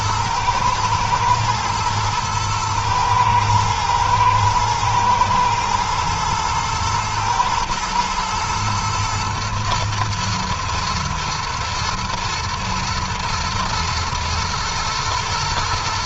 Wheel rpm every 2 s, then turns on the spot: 110, 120, 110, 110, 110, 110, 110, 120.
none